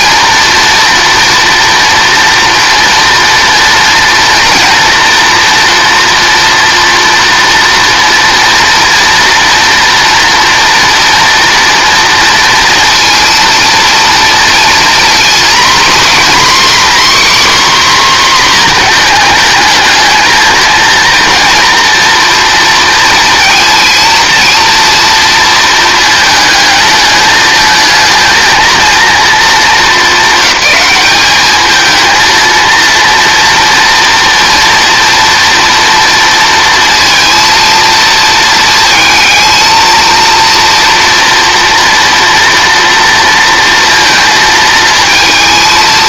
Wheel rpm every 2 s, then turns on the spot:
240, 230, 230, 230, 230, 230, 230, 230, 280, 240, 230, 230, 230, 220, 220, 210, 230, 230, 230, 220, 230, 230, 220.
none